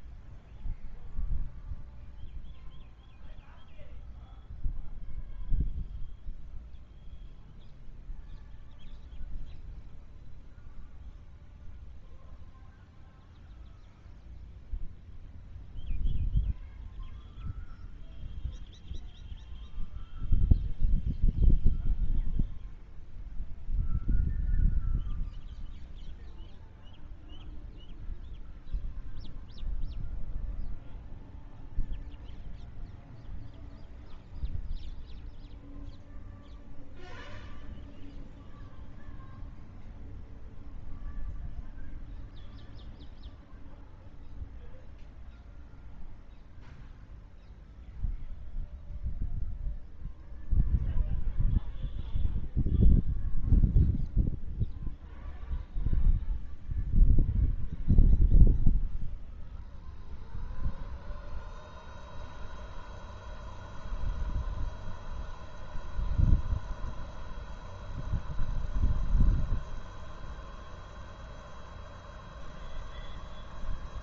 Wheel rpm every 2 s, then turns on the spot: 0, 0, 0, 0, 0, 0, 0, 0, 0, 0, 0, 0, 0, 0, 0, 0, 0, 0, 0, 0, 0, 0, 0, 0, 0, 0, 0, 0, 0, 0, 0, 0, 0, 0, 0, 0, 0.
none